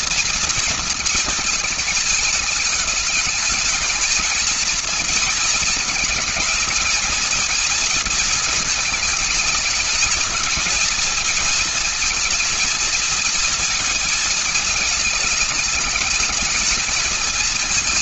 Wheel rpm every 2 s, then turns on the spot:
230, 210, 220, 220, 220, 230, 230, 220, 220.
none